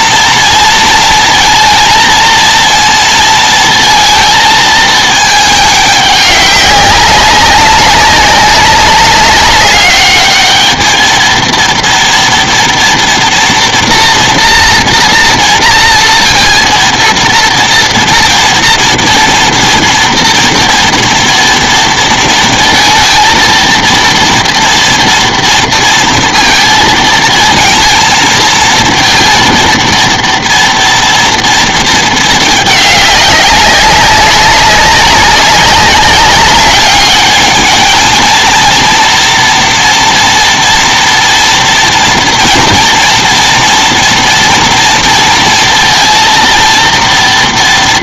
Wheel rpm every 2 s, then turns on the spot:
230, 230, 230, 200, 200, 210, 230, 230, 230, 230, 230, 230, 230, 230, 230, 230, 220, 190, 200, 220, 230, 240, 230, 230.
none